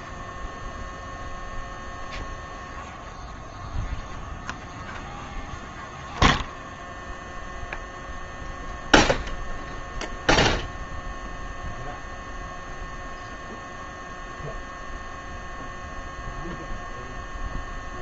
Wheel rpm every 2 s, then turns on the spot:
0, 0, 0, 0, 0, 0, 0, 0, 0.
none